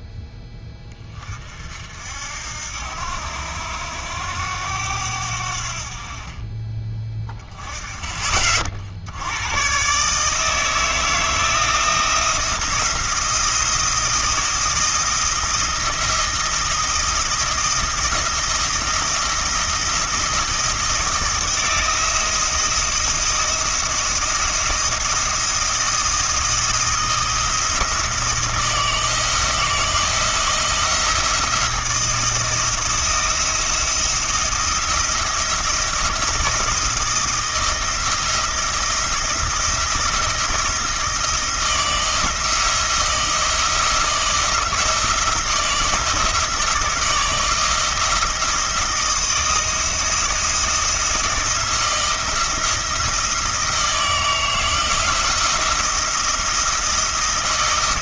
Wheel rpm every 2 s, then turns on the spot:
20, 80, 90, 20, 70, 160, 170, 160, 160, 160, 160, 170, 160, 160, 160, 170, 170, 170, 160, 170, 170, 170, 170, 170, 170, 170, 170, 160, 170.
none